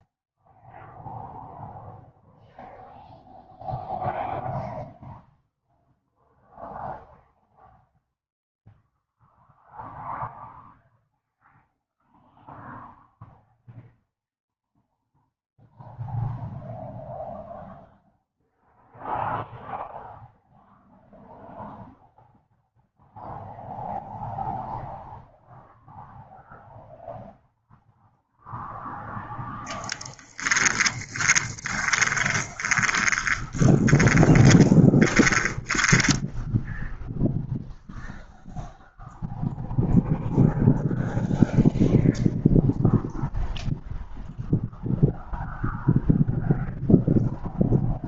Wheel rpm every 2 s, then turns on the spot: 0, 0, 0, 0, 0, 0, 0, 0, 0, 0, 0, 0, 0, 0, 0, 10, 20, 10, 0, 0, 0, 0, 0, 0.
30-36